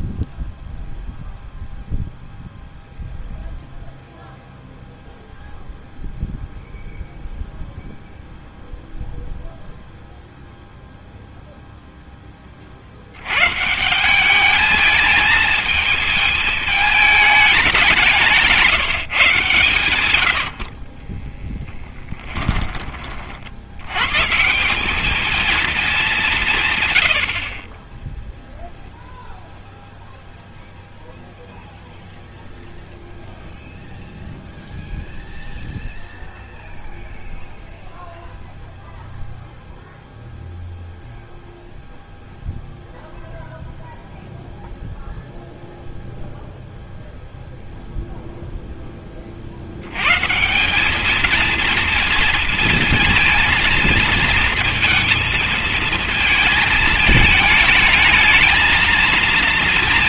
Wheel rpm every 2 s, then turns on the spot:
0, 0, 0, 0, 0, 0, 40, 210, 220, 160, 60, 20, 170, 150, 0, 0, 0, 0, 0, 0, 0, 0, 0, 0, 0, 180, 230, 220, 220, 220.
20-22